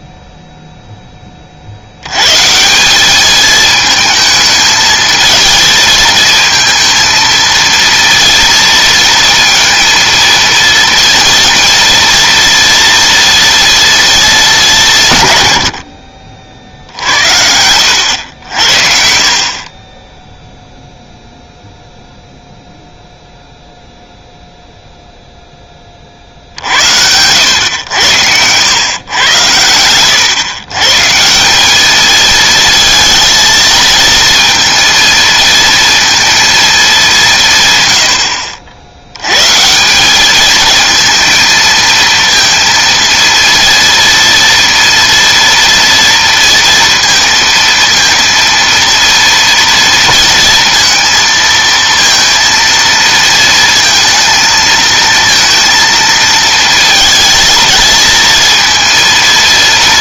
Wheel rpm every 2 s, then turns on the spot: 0, 150, 220, 230, 230, 230, 230, 200, 60, 70, 0, 0, 0, 70, 110, 120, 230, 230, 220, 70, 220, 230, 240, 230, 230, 230, 230, 220, 230, 230.
none